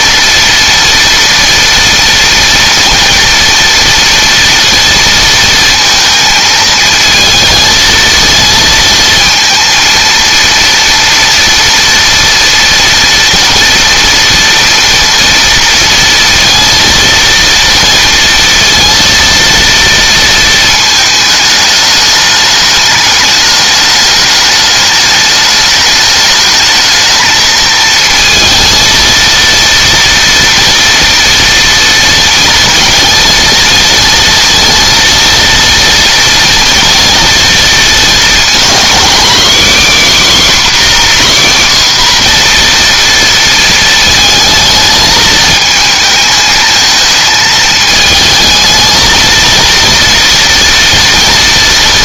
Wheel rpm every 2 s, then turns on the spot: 230, 230, 230, 220, 230, 230, 230, 230, 230, 230, 220, 210, 210, 220, 230, 230, 230, 230, 230, 240, 280, 240, 220, 220, 220, 230.
none